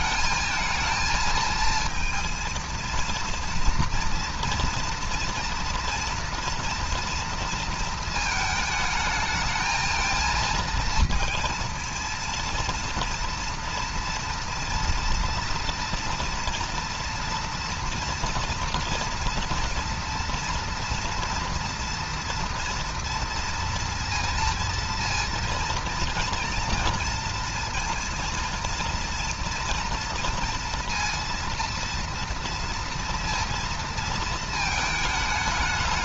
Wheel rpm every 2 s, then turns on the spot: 220, 230, 230, 230, 220, 230, 230, 230, 230, 230, 230, 230, 230, 230, 230, 230, 230, 230.
none